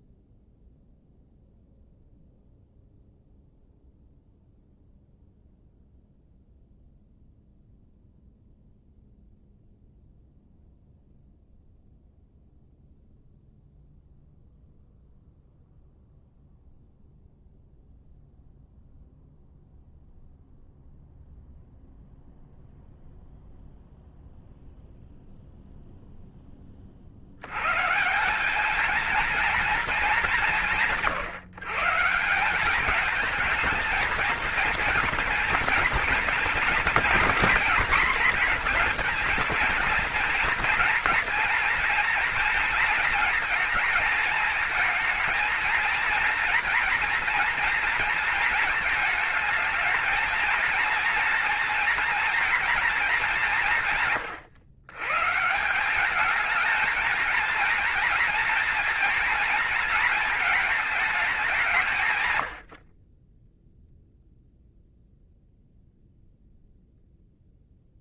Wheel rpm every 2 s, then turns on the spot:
0, 0, 0, 0, 0, 0, 0, 0, 0, 0, 0, 0, 0, 50, 230, 170, 210, 230, 230, 230, 240, 230, 220, 240, 230, 230, 220, 130, 230, 230, 210, 50, 0, 0.
none